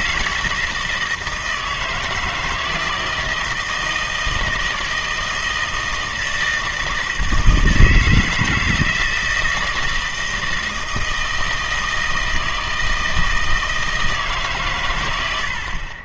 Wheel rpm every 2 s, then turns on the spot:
160, 160, 160, 160, 160, 160, 160, 140.
none